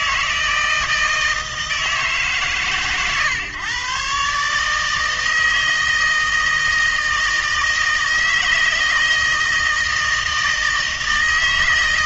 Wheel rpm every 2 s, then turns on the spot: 160, 130, 150, 160, 160, 160.
none